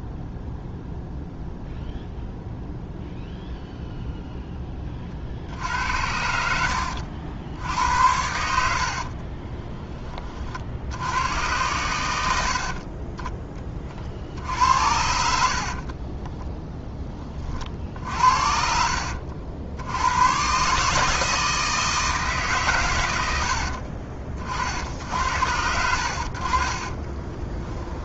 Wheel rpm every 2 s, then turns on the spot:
0, 0, 20, 70, 60, 70, 40, 80, 10, 60, 150, 120, 60, 30.
6-10 12-16 26-28